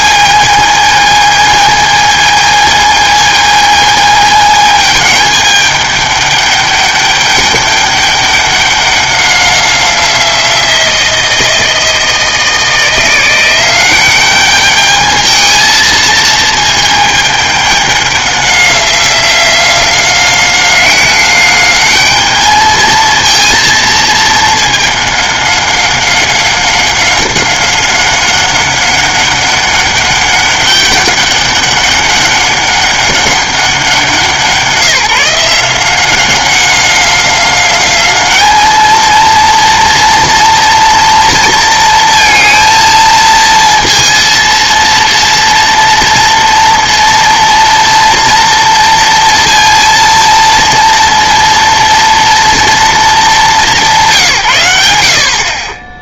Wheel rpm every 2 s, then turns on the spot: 220, 220, 220, 210, 200, 170, 160, 200, 220, 190, 190, 220, 210, 190, 200, 200, 200, 170, 190, 220, 230, 230, 230, 230, 230, 230, 230, 130.
none